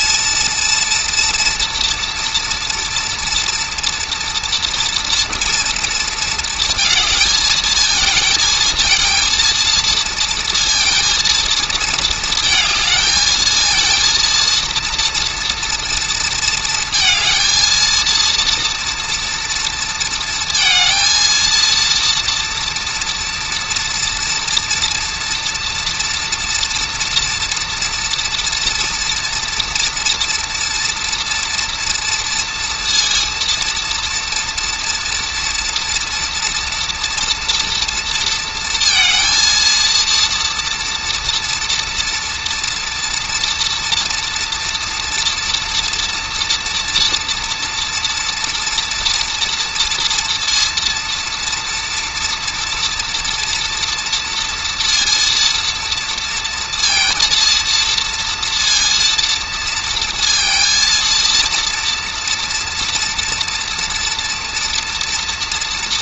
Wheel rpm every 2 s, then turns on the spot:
230, 230, 230, 230, 220, 230, 220, 230, 230, 240, 230, 230, 230, 230, 240, 230, 230, 230, 230, 230, 230, 230, 240, 230, 230, 240, 230, 230, 230, 230, 230, 230, 230.
none